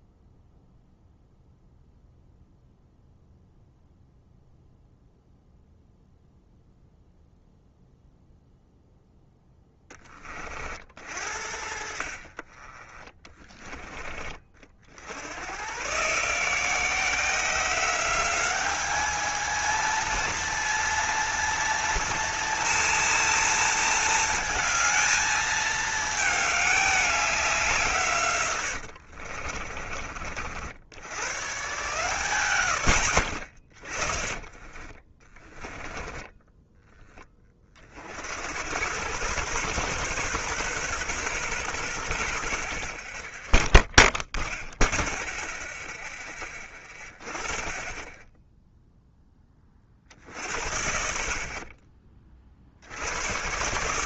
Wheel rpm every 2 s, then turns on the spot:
0, 0, 0, 0, 0, 40, 30, 60, 170, 210, 230, 230, 220, 210, 90, 80, 110, 30, 10, 100, 130, 40, 0, 20, 0, 70, 50.
28-30 34-36